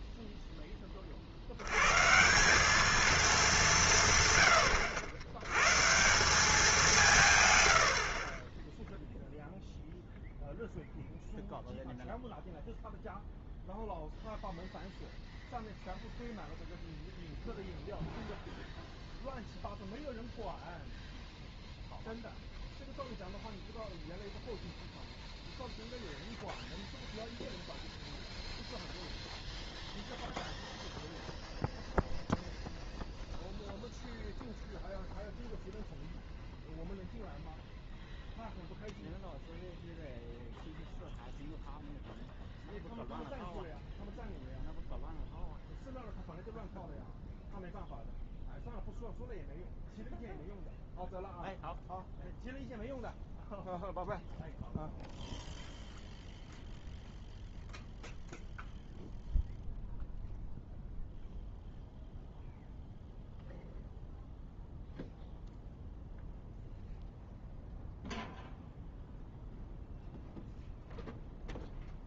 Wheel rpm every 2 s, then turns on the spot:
10, 200, 90, 200, 20, 0, 0, 0, 0, 0, 0, 0, 0, 0, 0, 0, 0, 0, 0, 0, 0, 0, 0, 0, 0, 0, 0, 0, 0, 0, 0, 0, 0, 0, 0, 0.
8-10